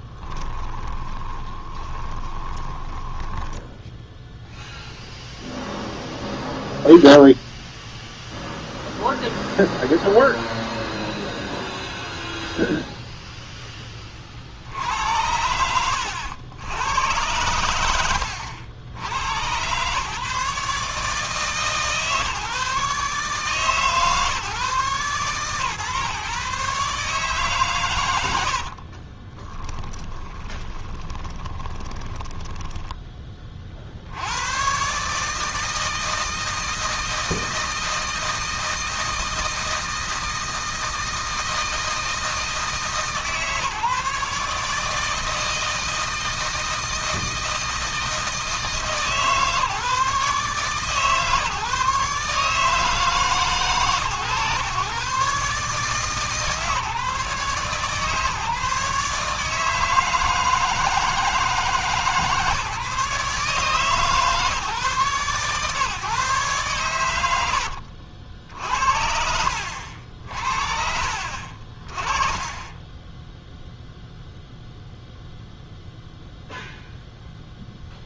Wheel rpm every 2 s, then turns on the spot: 20, 10, 0, 0, 0, 0, 0, 90, 100, 90, 150, 150, 130, 140, 30, 20, 20, 140, 160, 160, 160, 160, 160, 160, 150, 140, 150, 130, 150, 150, 160, 150, 140, 100, 70, 50, 10, 0, 0.
0-4 28-32 66-68